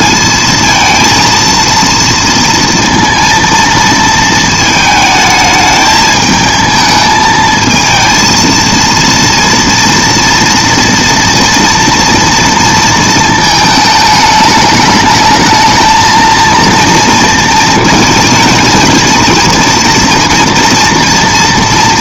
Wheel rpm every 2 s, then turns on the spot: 230, 230, 220, 220, 230, 230, 230, 210, 230, 230, 240.
none